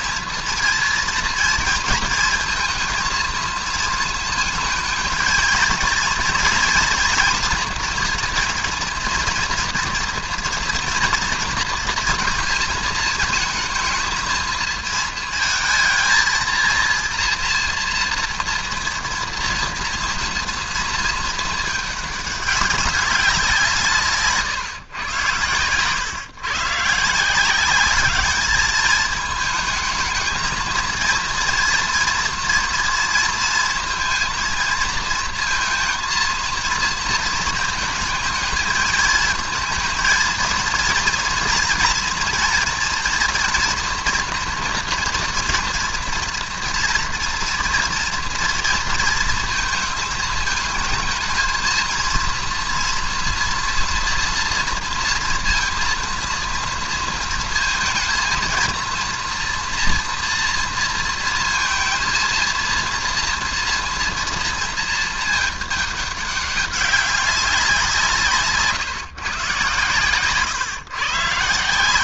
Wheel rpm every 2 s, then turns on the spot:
230, 230, 220, 230, 230, 230, 230, 220, 230, 240, 230, 200, 140, 130, 210, 220, 240, 230, 230, 220, 230, 230, 230, 230, 230, 220, 230, 240, 230, 230, 230, 230, 230, 200, 150, 130.
none